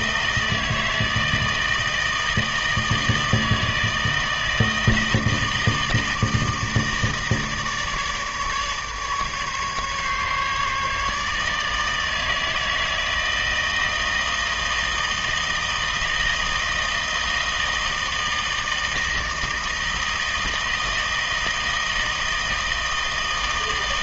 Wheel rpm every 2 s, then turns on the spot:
160, 160, 160, 160, 150, 150, 160, 160, 160, 160, 160, 160.
none